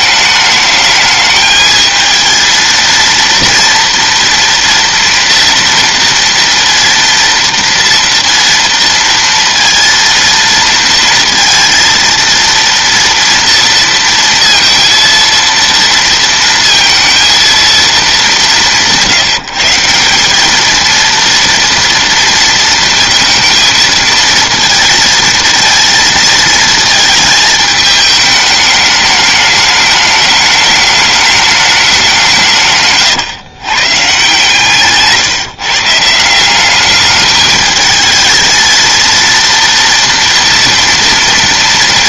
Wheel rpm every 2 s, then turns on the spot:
210, 230, 230, 230, 230, 230, 230, 230, 230, 180, 210, 230, 230, 220, 210, 210, 160, 140, 190, 220, 230.
none